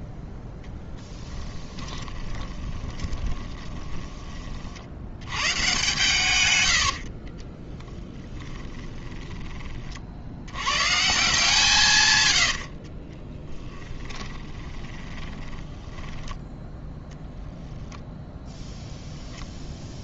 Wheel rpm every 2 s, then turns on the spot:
10, 20, 40, 90, 10, 100, 90, 20, 10, 10.
2-4 8-10 12-16